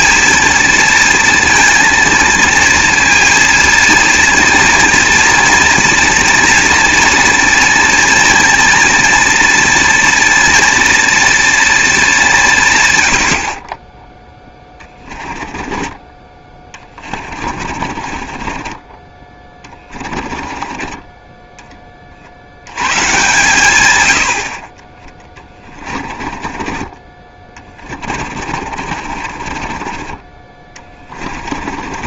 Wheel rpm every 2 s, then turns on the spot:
230, 230, 230, 240, 230, 240, 140, 20, 20, 20, 20, 90, 30, 20, 40, 20.
14-22 26-32